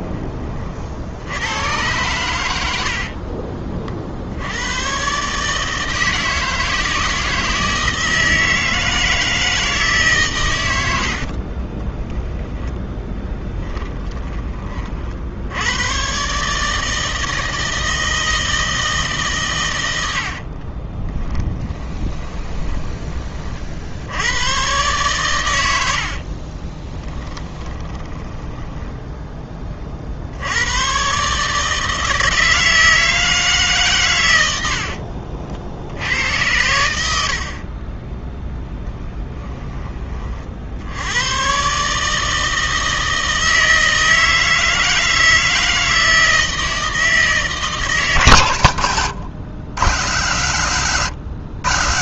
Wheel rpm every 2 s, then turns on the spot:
60, 70, 120, 160, 160, 90, 10, 40, 150, 160, 30, 20, 120, 20, 10, 110, 160, 60, 80, 10, 70, 160, 160, 160, 120, 130.
2-4 10-14 20-24 26-30 34-36 38-40 48-50